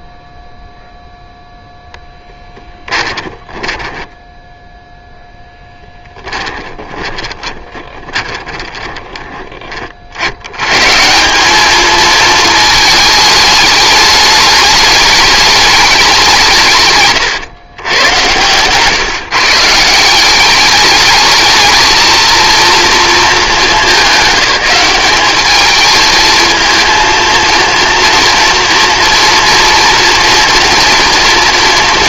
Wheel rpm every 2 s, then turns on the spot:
0, 10, 10, 30, 20, 110, 220, 210, 150, 130, 200, 230, 190, 220, 240, 240.
2-10